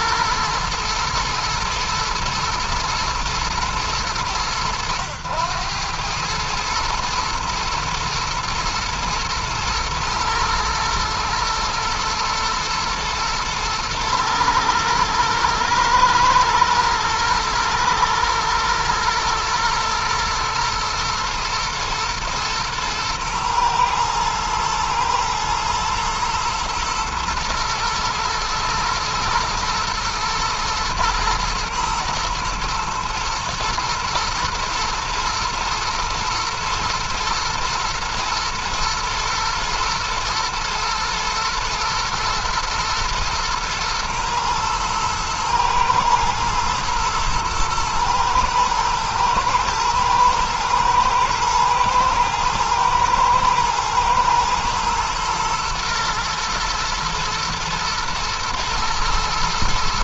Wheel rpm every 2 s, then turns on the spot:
110, 110, 100, 120, 110, 110, 110, 110, 120, 120, 110, 110, 120, 120, 120, 110, 110, 120, 110, 110, 120, 110, 120, 120, 110, 120, 110, 110, 120, 120.
none